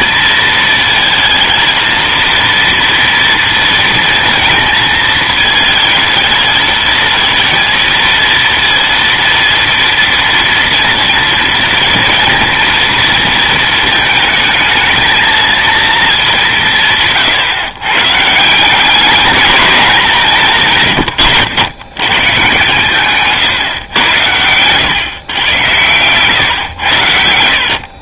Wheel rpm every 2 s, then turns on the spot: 230, 230, 220, 220, 230, 230, 230, 220, 160, 190, 140, 130, 120, 100.
20-22